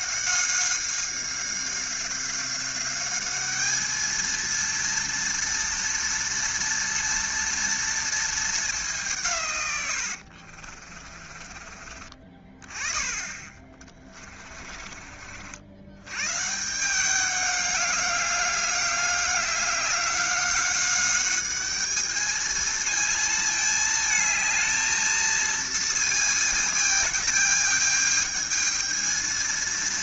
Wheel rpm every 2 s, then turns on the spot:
190, 190, 230, 230, 210, 50, 20, 30, 160, 200, 190, 220, 220, 220, 220.
10-12 14-16